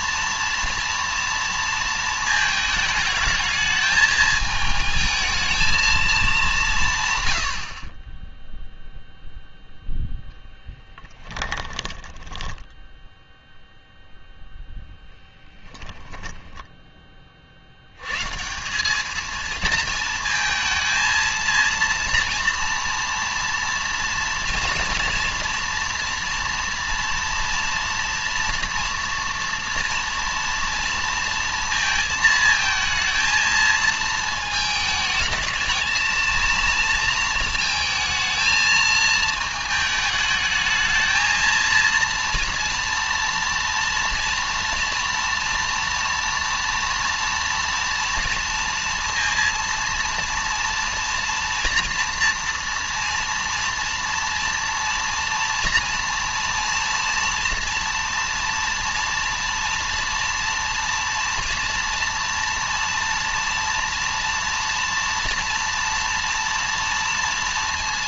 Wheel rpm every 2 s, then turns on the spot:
230, 220, 220, 170, 0, 0, 10, 0, 10, 180, 220, 230, 230, 230, 240, 230, 220, 220, 230, 220, 220, 230, 230, 230, 230, 230, 230, 230, 230, 230, 230, 230, 230, 230.
12-14